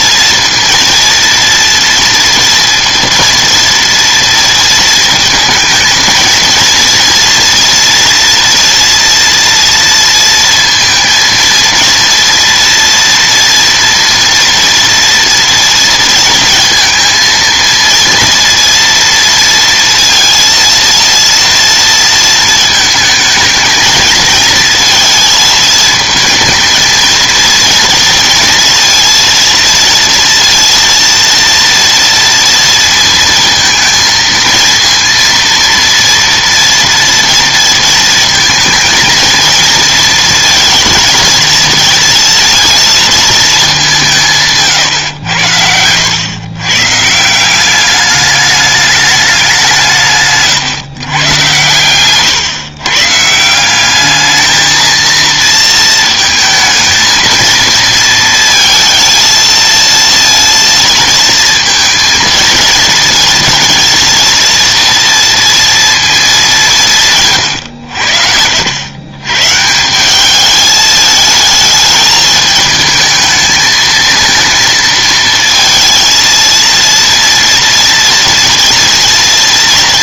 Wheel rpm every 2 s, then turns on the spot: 230, 230, 230, 230, 230, 230, 230, 240, 220, 230, 230, 220, 230, 220, 230, 230, 230, 230, 230, 230, 230, 230, 150, 120, 210, 140, 130, 220, 220, 230, 230, 220, 230, 190, 80, 210, 220, 230, 230, 230.
none